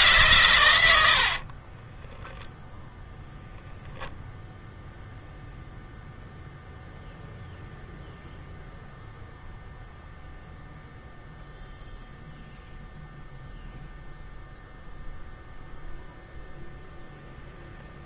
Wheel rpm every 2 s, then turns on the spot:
90, 0, 0, 0, 0, 0, 0, 0, 0.
0-2